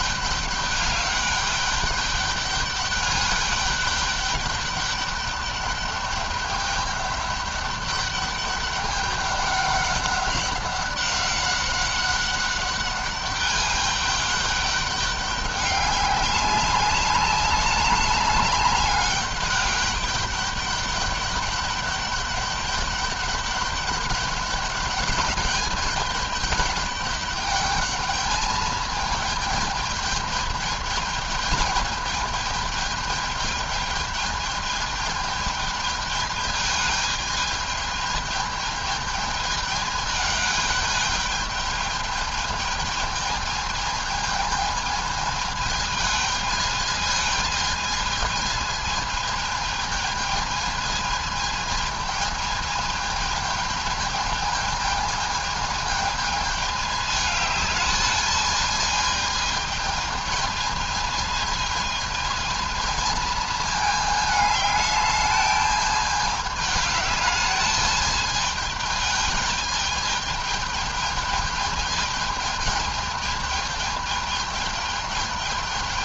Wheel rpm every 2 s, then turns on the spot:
200, 200, 210, 200, 200, 200, 200, 200, 190, 200, 200, 200, 210, 200, 210, 220, 220, 210, 210, 210, 210, 220, 220, 220, 220, 220, 220, 220, 210, 220, 220, 220, 210, 210, 210, 210, 210, 210.
none